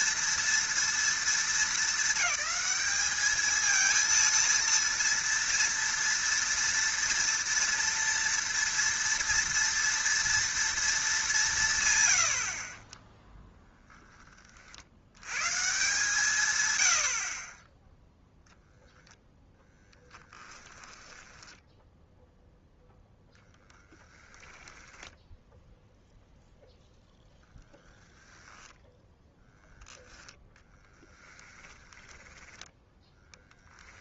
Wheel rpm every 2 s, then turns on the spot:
230, 200, 230, 230, 230, 230, 40, 50, 110, 0, 10, 0, 10, 0, 0, 10, 10.
20-22 24-26 30-34